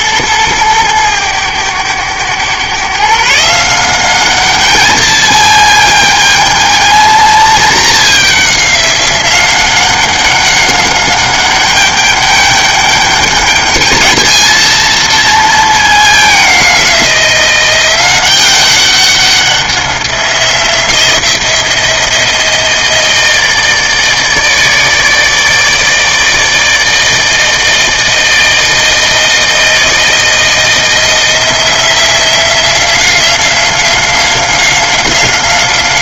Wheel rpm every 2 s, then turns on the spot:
110, 120, 210, 220, 200, 190, 200, 220, 190, 190, 180, 160, 150, 160, 160, 160, 180, 190.
none